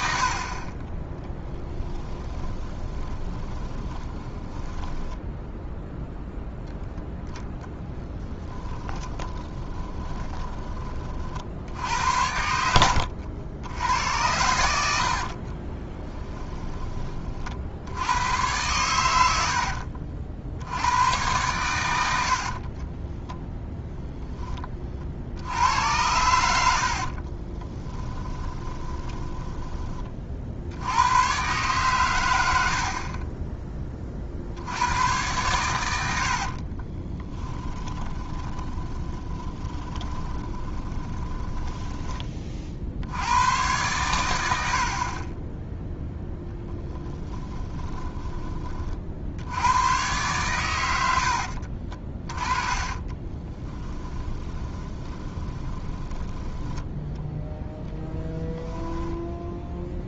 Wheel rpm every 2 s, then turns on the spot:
20, 20, 20, 0, 20, 30, 80, 90, 20, 100, 80, 40, 40, 70, 20, 80, 50, 90, 40, 20, 20, 60, 60, 10, 30, 90, 30, 20, 10, 0.
2-6 8-10 12-14 22-24 28-30 32-34 36-42 52-58